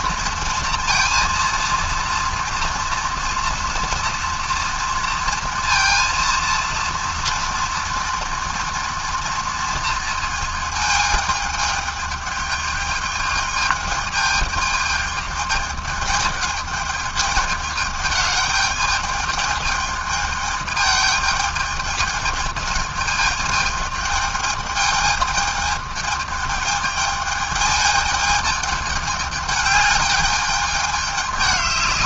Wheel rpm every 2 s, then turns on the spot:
230, 230, 230, 230, 230, 220, 210, 220, 210, 210, 210, 220, 210, 210, 210, 210.
none